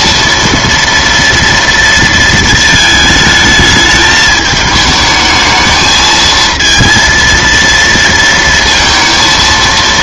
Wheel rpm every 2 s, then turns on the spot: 230, 220, 220, 230, 230.
none